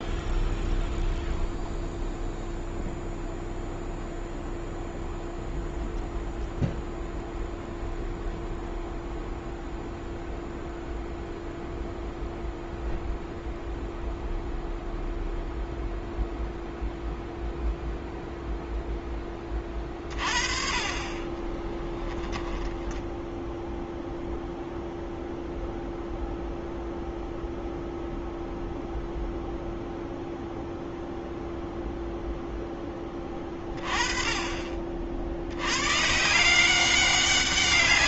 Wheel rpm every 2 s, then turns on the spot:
0, 0, 0, 0, 0, 0, 0, 0, 0, 0, 30, 0, 0, 0, 0, 0, 10, 40, 180.
none